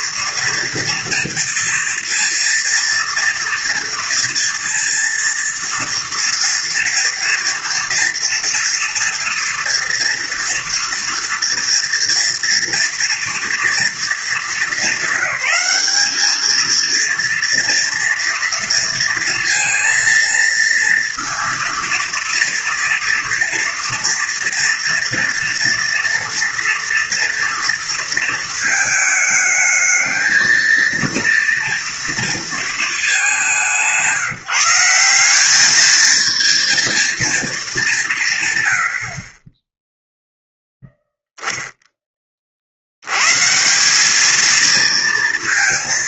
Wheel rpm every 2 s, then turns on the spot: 230, 230, 230, 230, 230, 230, 230, 220, 220, 230, 230, 230, 230, 230, 220, 230, 220, 170, 230, 100, 0, 70, 230.
none